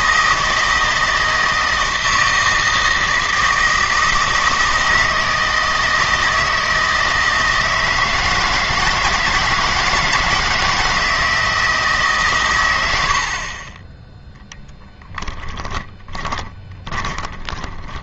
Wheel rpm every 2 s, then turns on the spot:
160, 160, 160, 160, 160, 160, 110, 10, 20.
16-18